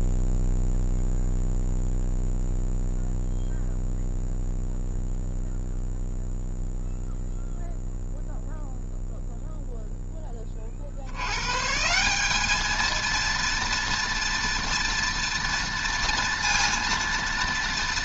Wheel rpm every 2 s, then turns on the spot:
0, 0, 0, 0, 0, 30, 210, 230, 230.
none